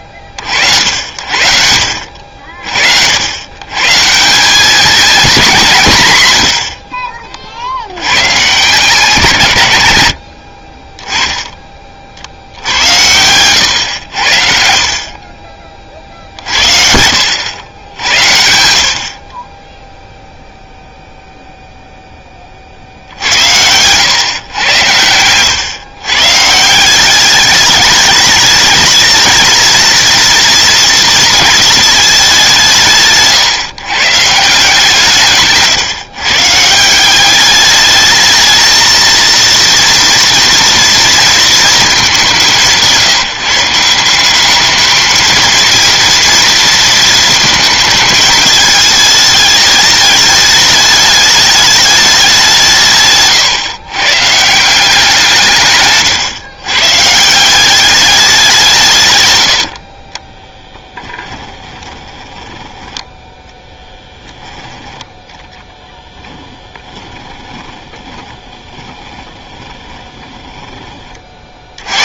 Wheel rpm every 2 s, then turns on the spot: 60, 60, 210, 60, 160, 30, 90, 60, 60, 70, 0, 50, 110, 170, 210, 230, 160, 170, 170, 230, 230, 170, 210, 230, 220, 220, 150, 170, 140, 170, 10, 10, 10, 20, 20, 20.
10-12 60-64 66-70